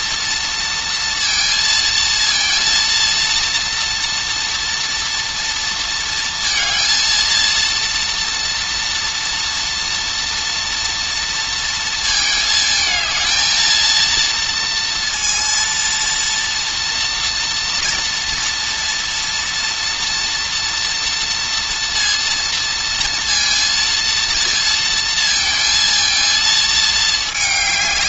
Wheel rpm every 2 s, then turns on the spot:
230, 230, 230, 230, 230, 230, 220, 230, 230, 230, 230, 230, 230, 230.
none